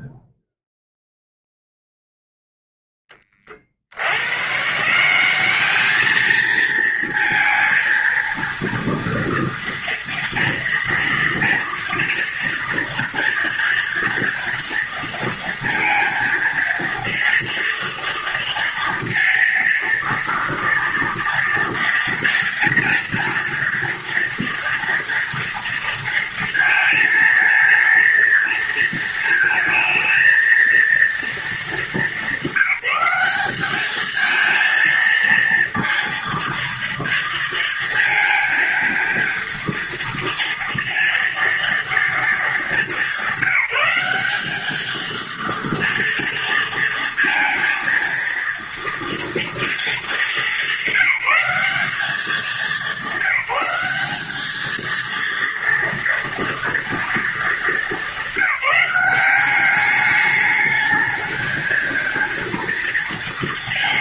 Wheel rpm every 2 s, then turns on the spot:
0, 0, 140, 220, 230, 230, 230, 230, 230, 230, 230, 230, 230, 230, 230, 230, 210, 220, 230, 230, 230, 210, 200, 230, 230, 210, 200, 210, 230, 200, 210, 230.
none